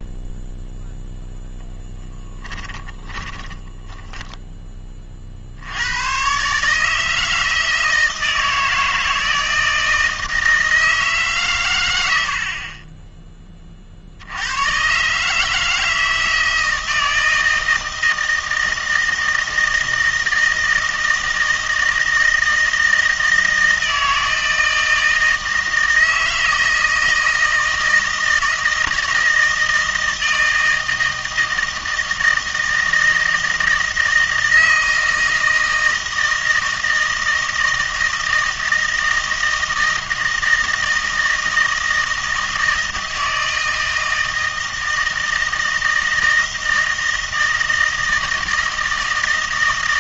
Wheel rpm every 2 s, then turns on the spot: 0, 20, 20, 140, 160, 160, 40, 110, 160, 160, 160, 160, 160, 160, 160, 160, 160, 160, 160, 160, 160, 160, 160, 160, 160.
2-4